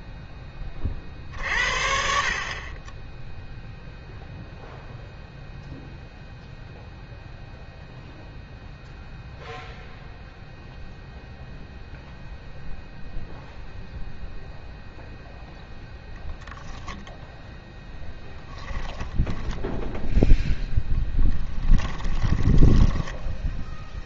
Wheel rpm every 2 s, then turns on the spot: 30, 30, 0, 0, 0, 0, 0, 0, 0, 20, 0, 10.
18-20 22-24